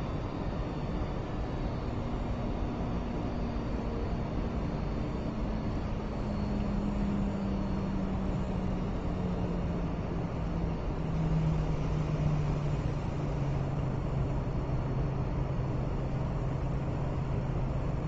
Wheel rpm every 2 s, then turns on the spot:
0, 0, 0, 0, 0, 0, 0, 0, 0.
none